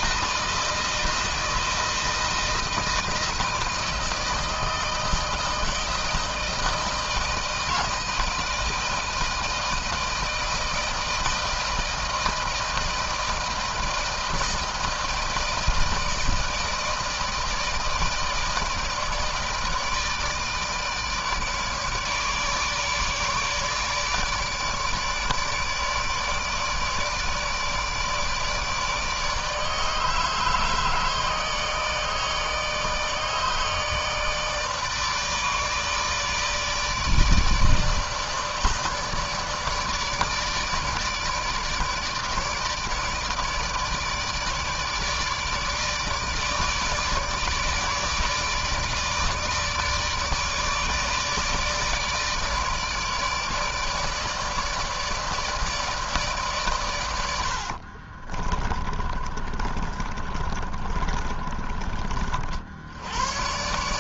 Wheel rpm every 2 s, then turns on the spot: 160, 160, 160, 160, 160, 160, 160, 160, 160, 160, 160, 150, 150, 150, 150, 160, 160, 150, 160, 160, 150, 150, 160, 150, 150, 150, 150, 160, 140, 30, 40, 50.
58-62